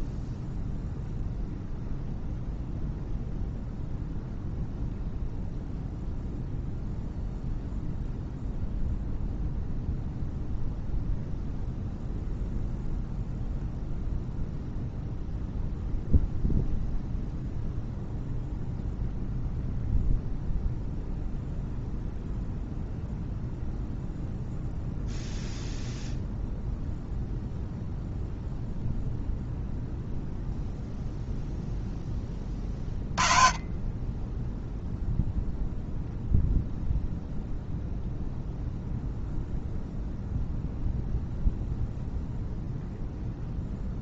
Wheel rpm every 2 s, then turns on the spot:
0, 0, 0, 0, 0, 0, 0, 0, 0, 0, 0, 0, 0, 0, 0, 0, 30, 0, 0, 0, 0, 0.
none